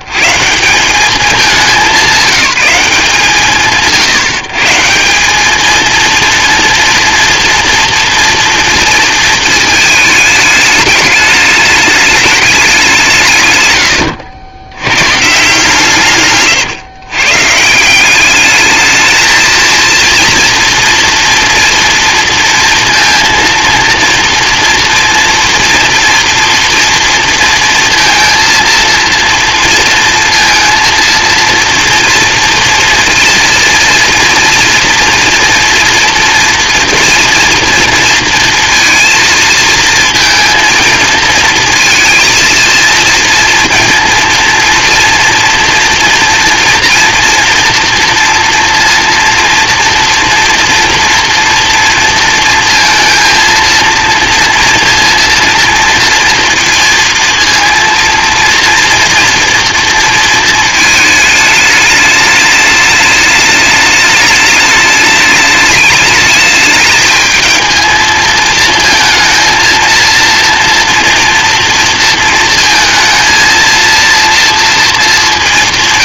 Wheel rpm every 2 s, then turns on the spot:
100, 180, 140, 230, 230, 220, 210, 80, 140, 200, 230, 230, 230, 230, 230, 230, 230, 230, 230, 230, 230, 230, 230, 240, 230, 240, 230, 230, 230, 230, 230, 210, 210, 210, 220, 230, 220, 230.
none